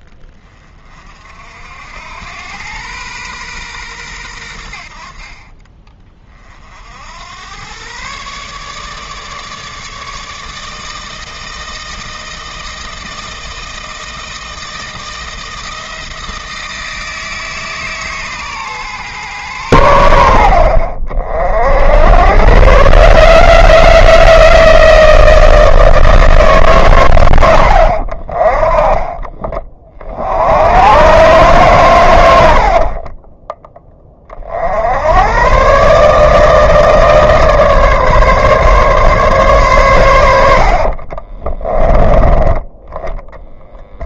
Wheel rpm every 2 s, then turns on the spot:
30, 110, 70, 60, 150, 160, 160, 160, 160, 130, 60, 120, 160, 140, 20, 100, 60, 70, 160, 140, 50, 10.
32-34 40-42